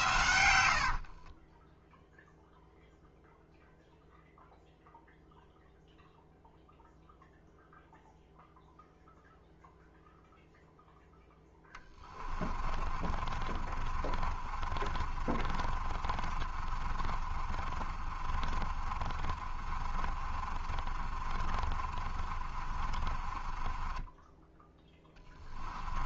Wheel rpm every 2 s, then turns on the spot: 70, 0, 0, 0, 0, 0, 30, 30, 30, 40, 40, 30, 10.
0-2 12-26